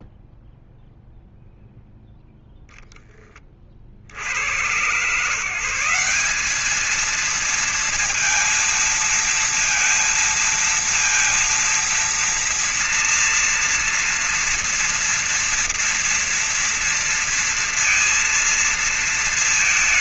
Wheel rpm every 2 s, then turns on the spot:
0, 0, 100, 210, 230, 230, 230, 230, 230, 230.
none